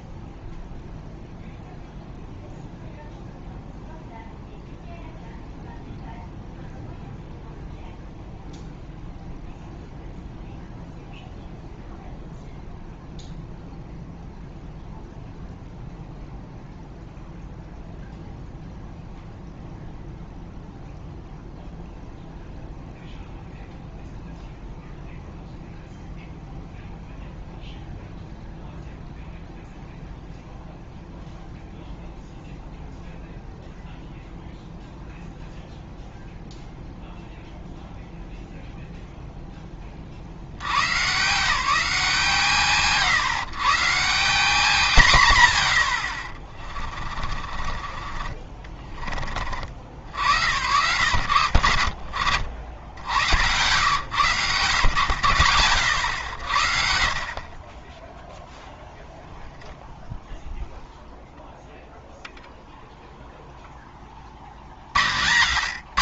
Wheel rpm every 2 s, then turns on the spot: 0, 0, 0, 0, 0, 0, 0, 0, 0, 0, 0, 0, 0, 0, 0, 0, 0, 0, 0, 0, 90, 160, 190, 30, 30, 80, 70, 120, 70, 0, 0, 0, 70.
46-48